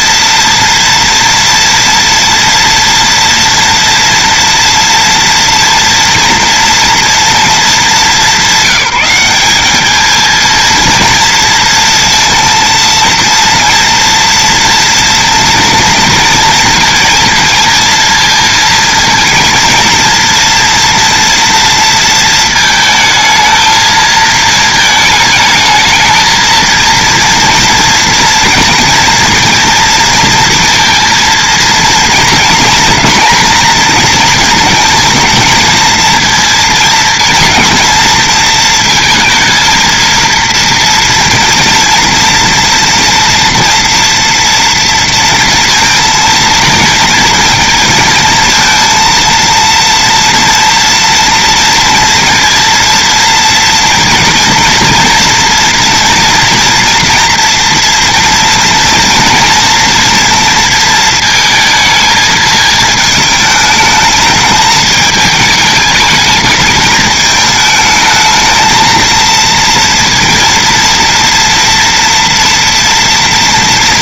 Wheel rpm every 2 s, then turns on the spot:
230, 230, 230, 230, 190, 230, 230, 230, 230, 230, 230, 220, 220, 230, 230, 230, 230, 220, 230, 230, 230, 230, 230, 230, 230, 230, 230, 230, 230, 230, 230, 220, 210, 220, 220, 230, 230.
none